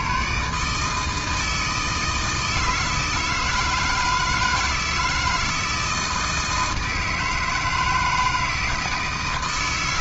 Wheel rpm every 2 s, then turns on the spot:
150, 160, 160, 160, 160.
none